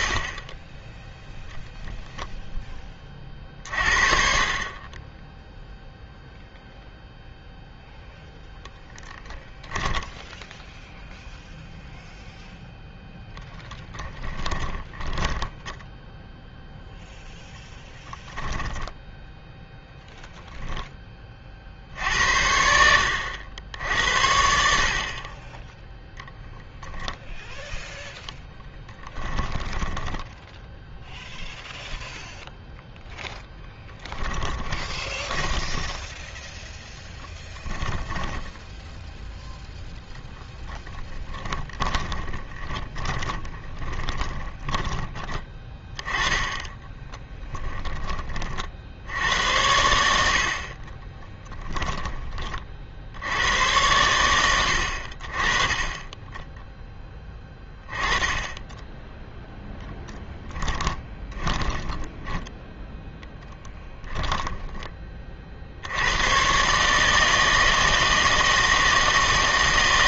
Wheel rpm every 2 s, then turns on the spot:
10, 10, 30, 0, 0, 0, 0, 10, 0, 10, 0, 80, 70, 10, 20, 0, 0, 20, 10, 10, 20, 20, 20, 10, 60, 50, 40, 80, 10, 10, 10, 10, 10, 140, 160.
14-16 18-20 28-30 34-48 50-52 60-62